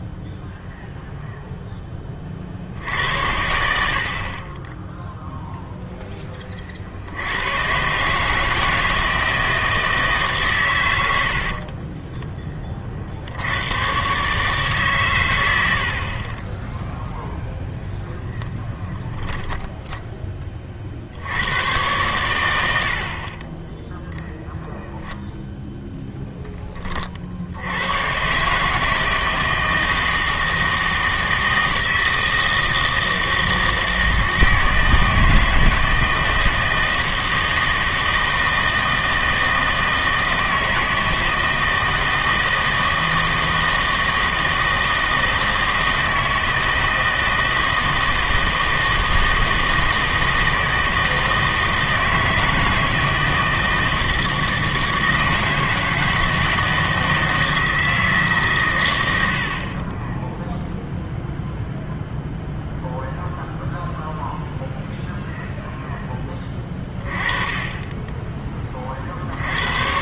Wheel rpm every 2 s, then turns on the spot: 0, 60, 30, 40, 160, 120, 30, 150, 10, 0, 30, 80, 0, 10, 150, 160, 160, 160, 160, 160, 160, 160, 160, 160, 160, 160, 160, 160, 160, 140, 0, 0, 0, 20, 20.
none